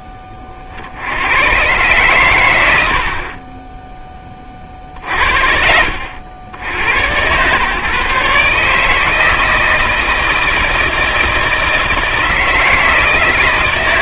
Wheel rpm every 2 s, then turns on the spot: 40, 80, 40, 80, 150, 160, 160.
none